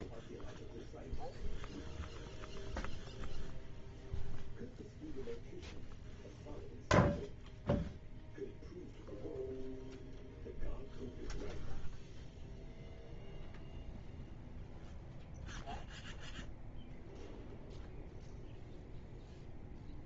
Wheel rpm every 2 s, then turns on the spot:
0, 0, 0, 0, 0, 0, 0, 0, 0, 0.
none